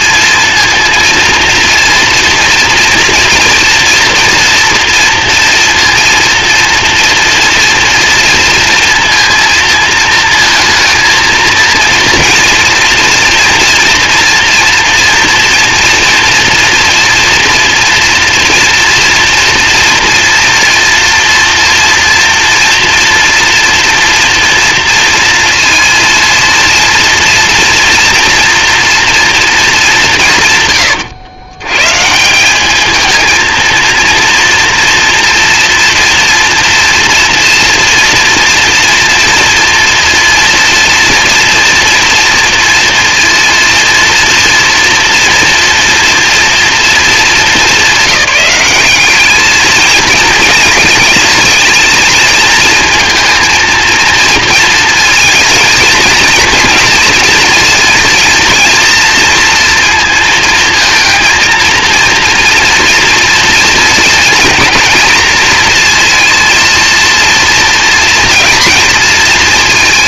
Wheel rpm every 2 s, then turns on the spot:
230, 240, 230, 230, 230, 220, 230, 240, 240, 230, 230, 230, 230, 230, 230, 110, 190, 230, 240, 230, 230, 230, 230, 240, 200, 220, 230, 230, 230, 230, 230, 230, 230, 230, 230.
none